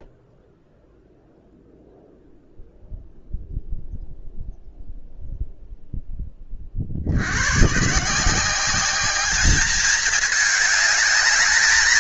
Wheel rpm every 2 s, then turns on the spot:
0, 0, 0, 30, 180, 210.
none